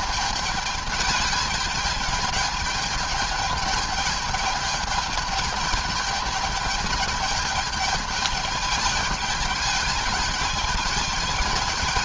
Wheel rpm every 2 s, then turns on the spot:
210, 210, 210, 210, 210, 210.
none